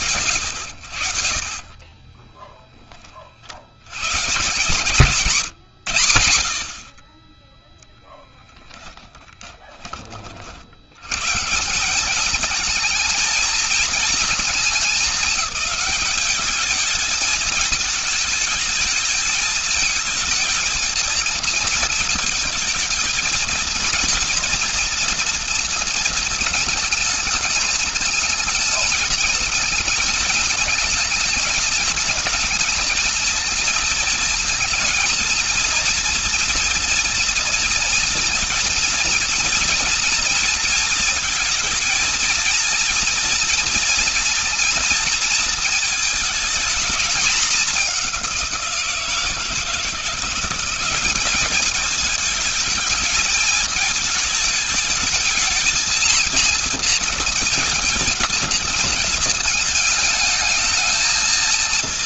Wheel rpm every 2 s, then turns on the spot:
70, 60, 150, 20, 10, 140, 220, 200, 220, 220, 230, 220, 230, 210, 220, 220, 230, 230, 230, 230, 220, 230, 230, 210, 160, 200, 220, 220, 230, 220, 220.
none